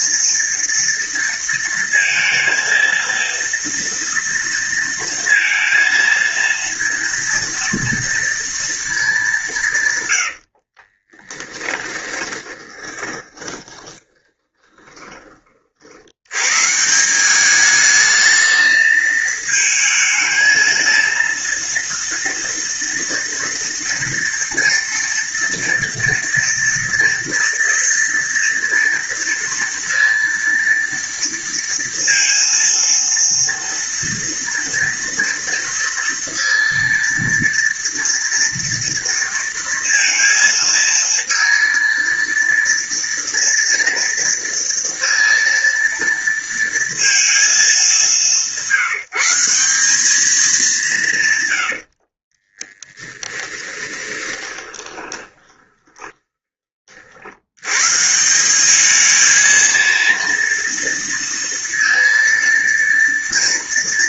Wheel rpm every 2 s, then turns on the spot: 230, 230, 230, 230, 230, 90, 20, 20, 100, 220, 220, 230, 230, 230, 230, 230, 230, 230, 230, 230, 230, 230, 230, 230, 170, 210, 50, 20, 20, 160, 230, 230.
10-16 52-58